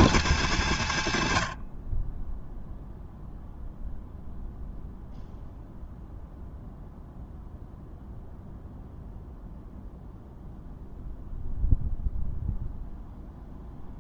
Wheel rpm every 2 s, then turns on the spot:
100, 0, 0, 0, 0, 0, 0.
none